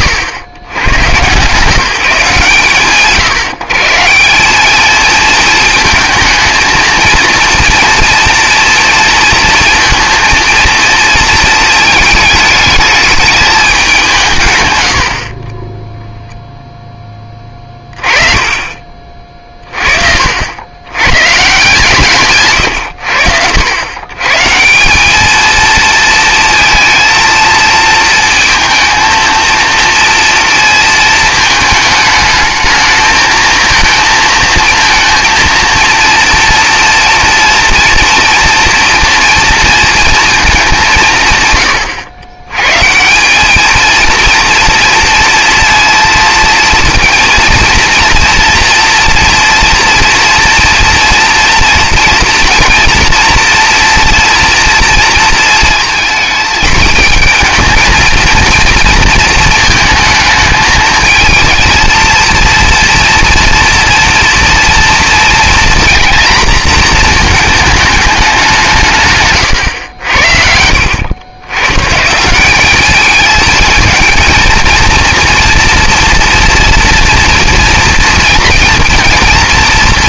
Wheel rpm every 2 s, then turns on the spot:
90, 120, 200, 230, 230, 230, 210, 100, 0, 30, 90, 100, 190, 230, 230, 220, 220, 230, 230, 230, 190, 150, 230, 230, 230, 230, 240, 230, 220, 230, 220, 230, 230, 230, 160, 70, 200, 230, 230, 240.
none